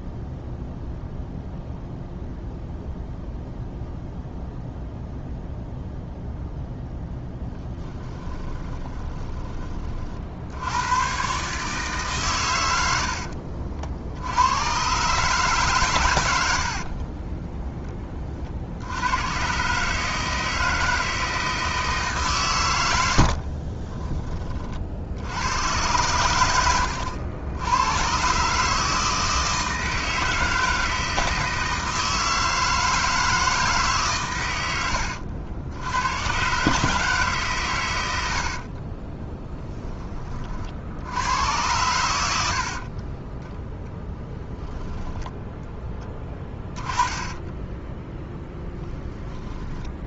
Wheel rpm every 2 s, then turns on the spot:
0, 0, 0, 0, 20, 90, 90, 120, 60, 70, 160, 90, 50, 90, 150, 160, 160, 90, 140, 40, 70, 60, 0, 20, 0.
8-10 16-18 26-28 38-40 42-44 46-48